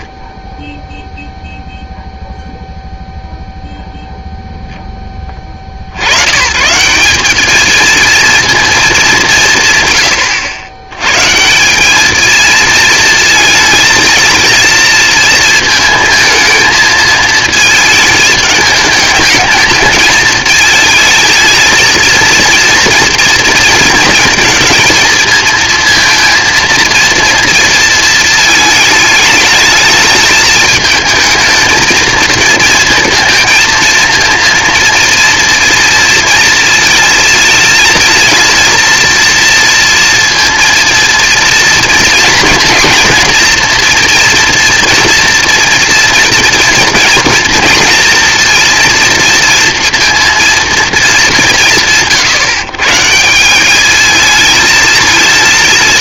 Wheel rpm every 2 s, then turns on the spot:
0, 0, 0, 140, 230, 100, 220, 220, 220, 210, 230, 230, 230, 230, 220, 220, 230, 230, 230, 230, 230, 230, 230, 230, 230, 230, 140, 220.
none